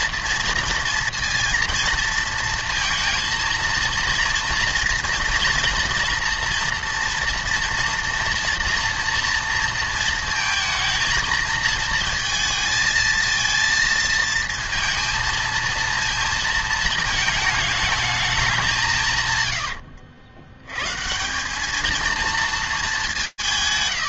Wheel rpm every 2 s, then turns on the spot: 230, 230, 230, 230, 230, 230, 230, 230, 220, 180, 100, 150.
none